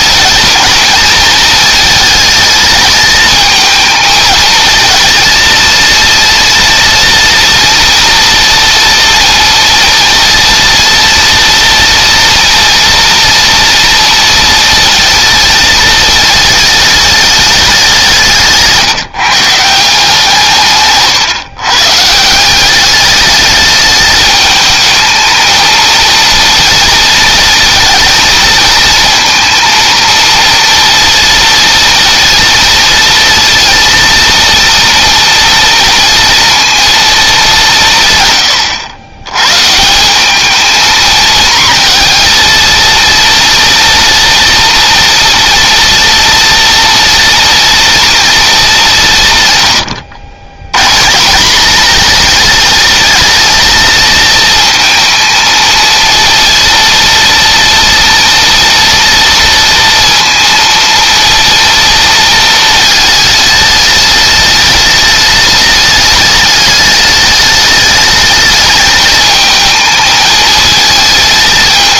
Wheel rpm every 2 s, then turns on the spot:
220, 220, 220, 240, 230, 230, 230, 230, 210, 160, 130, 200, 220, 220, 230, 230, 230, 230, 220, 100, 220, 230, 230, 230, 180, 130, 220, 220, 230, 230, 230, 220, 210, 210, 220, 220.
none